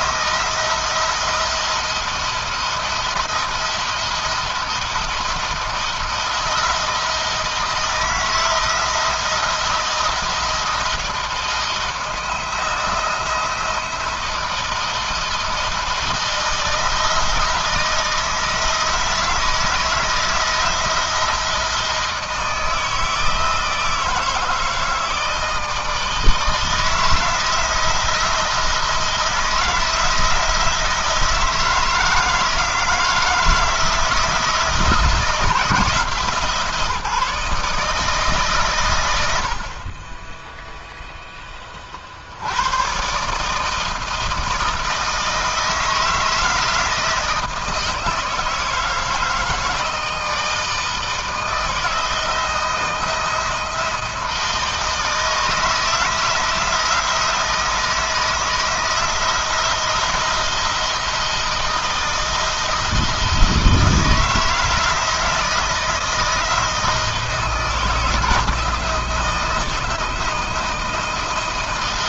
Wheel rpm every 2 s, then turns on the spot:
170, 170, 160, 170, 160, 170, 160, 170, 160, 160, 160, 160, 160, 160, 170, 170, 160, 160, 160, 130, 20, 110, 160, 160, 160, 160, 160, 160, 160, 160, 170, 160, 160, 160, 160, 170.
none